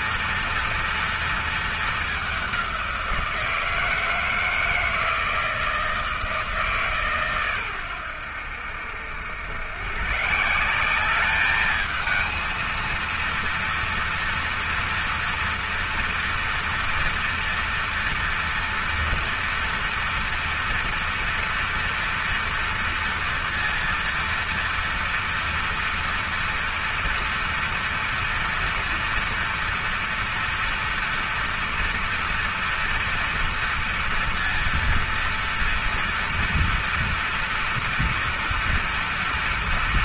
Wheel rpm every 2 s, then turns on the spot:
230, 190, 160, 150, 80, 180, 230, 230, 230, 230, 230, 230, 230, 230, 230, 230, 230, 230, 240, 230.
none